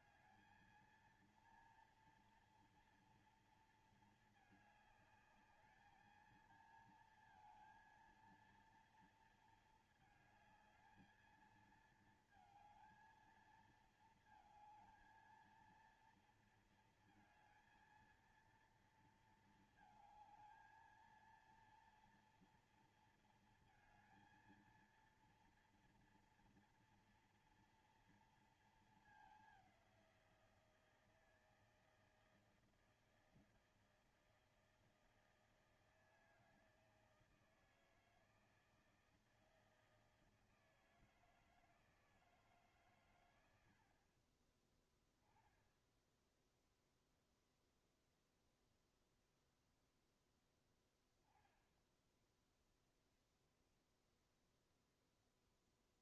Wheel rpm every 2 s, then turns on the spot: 230, 230, 220, 220, 230, 220, 220, 220, 230, 230, 220, 230, 230, 230, 230, 180, 160, 160, 160, 160, 160, 160, 30, 10, 0, 0, 0, 0.
none